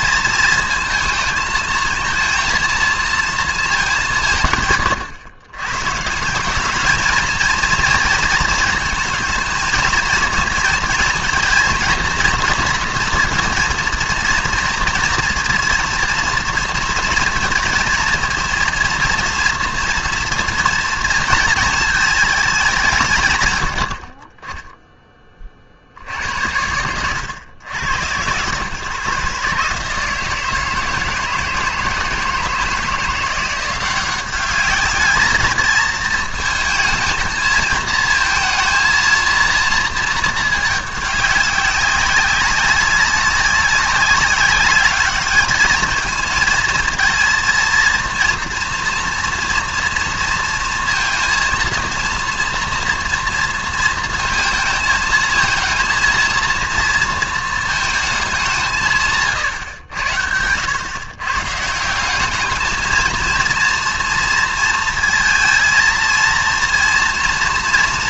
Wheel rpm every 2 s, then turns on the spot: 220, 230, 140, 190, 230, 230, 230, 230, 230, 230, 230, 200, 20, 80, 110, 160, 160, 200, 220, 230, 210, 190, 200, 230, 240, 230, 240, 220, 230, 190, 90, 220, 230, 230.
none